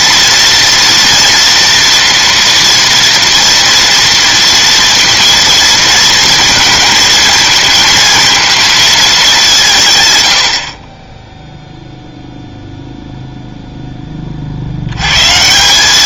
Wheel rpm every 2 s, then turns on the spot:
230, 230, 230, 230, 230, 100, 0, 40.
none